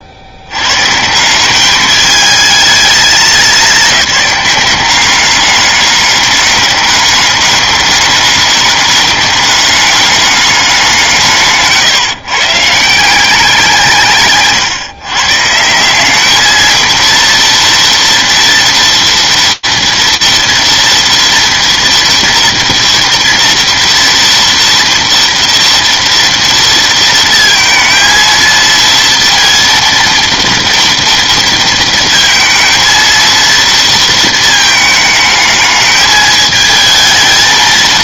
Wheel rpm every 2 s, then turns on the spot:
110, 220, 190, 200, 200, 190, 150, 140, 220, 230, 230, 230, 230, 230, 230, 230, 230, 220, 220.
none